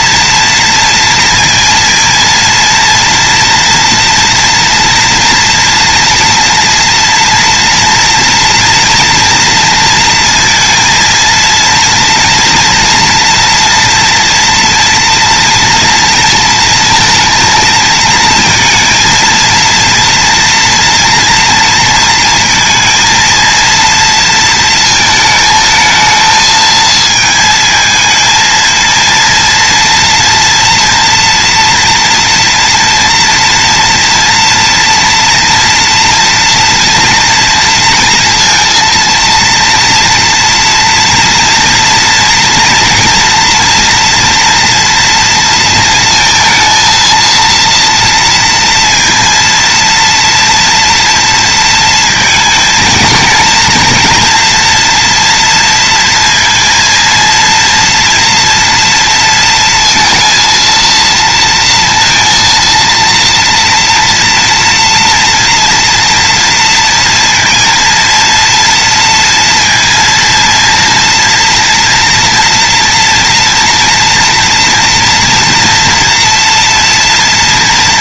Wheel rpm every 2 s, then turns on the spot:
230, 230, 230, 230, 230, 230, 230, 230, 230, 230, 230, 230, 220, 220, 230, 240, 230, 230, 230, 230, 230, 240, 230, 230, 230, 230, 230, 240, 230, 230, 230, 230, 230, 230, 230, 230, 230, 230, 240.
none